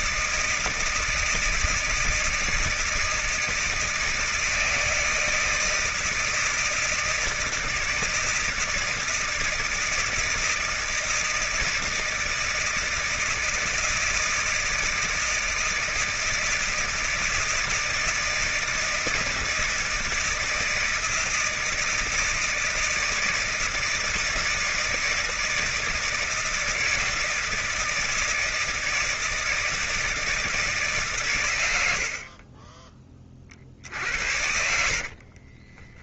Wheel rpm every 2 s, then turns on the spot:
160, 160, 160, 160, 160, 170, 160, 160, 160, 160, 160, 160, 160, 160, 160, 160, 30, 70.
32-36